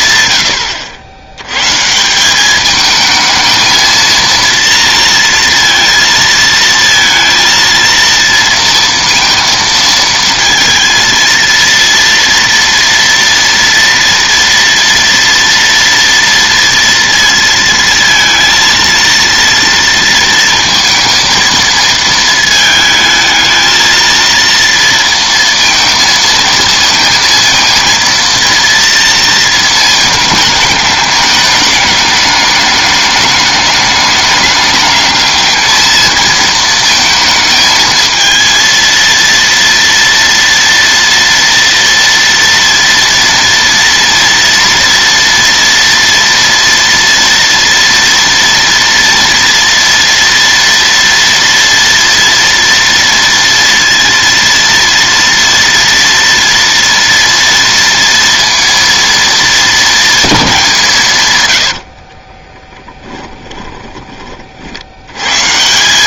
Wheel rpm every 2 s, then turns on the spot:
80, 220, 230, 230, 230, 230, 230, 230, 230, 230, 230, 220, 230, 230, 220, 210, 210, 220, 220, 230, 230, 230, 230, 230, 230, 240, 230, 230, 230, 230, 100, 10, 140.
60-64